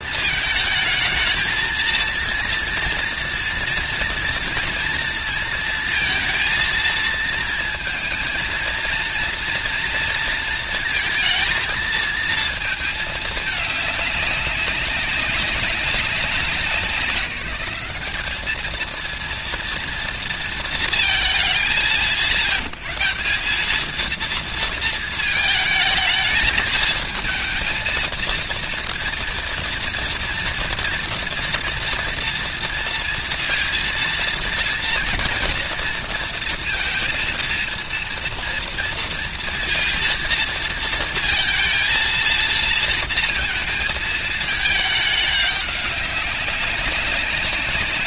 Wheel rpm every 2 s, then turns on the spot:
220, 230, 230, 230, 230, 230, 220, 200, 180, 220, 230, 150, 230, 220, 230, 240, 230, 230, 230, 230, 230, 230, 220, 190.
none